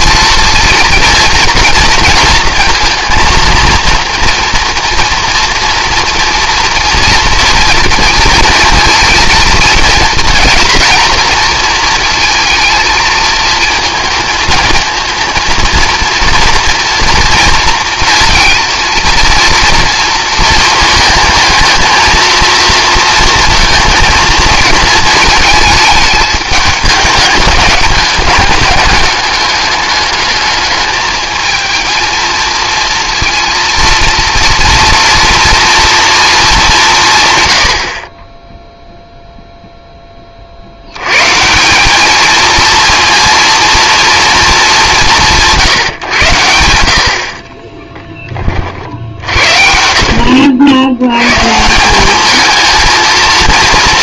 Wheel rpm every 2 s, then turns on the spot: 230, 230, 230, 230, 230, 230, 230, 230, 230, 230, 220, 230, 220, 210, 210, 210, 230, 230, 200, 0, 70, 230, 210, 80, 40, 70, 220.
none